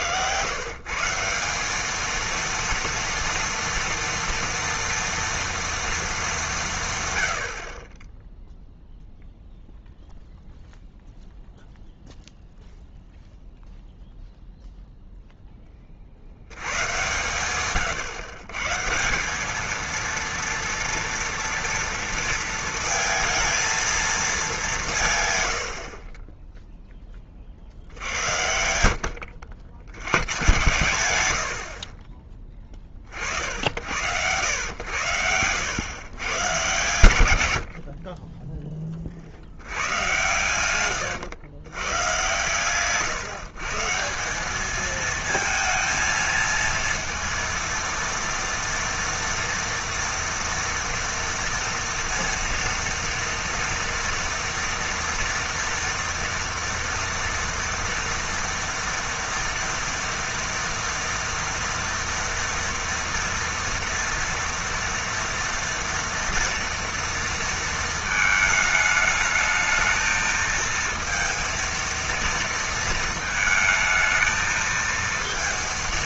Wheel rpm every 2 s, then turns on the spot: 120, 230, 230, 190, 0, 0, 0, 0, 90, 140, 230, 230, 210, 10, 90, 100, 20, 100, 120, 20, 110, 120, 210, 230, 230, 230, 230, 230, 230, 230, 230, 230, 230, 230, 220, 220, 230, 230.
none